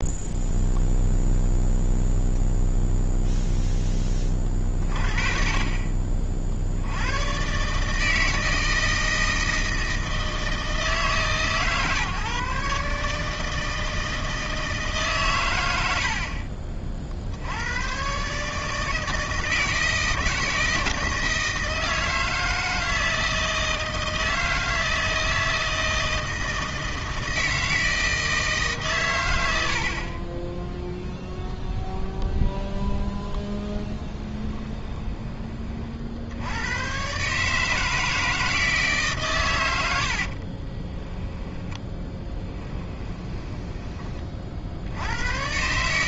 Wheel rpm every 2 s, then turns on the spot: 0, 0, 30, 60, 160, 160, 140, 160, 40, 150, 160, 160, 160, 160, 150, 0, 0, 10, 100, 160, 30, 10, 60.
34-36 40-44